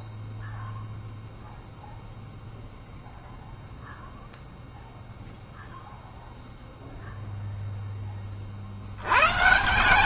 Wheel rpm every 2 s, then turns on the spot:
0, 0, 0, 0, 140.
none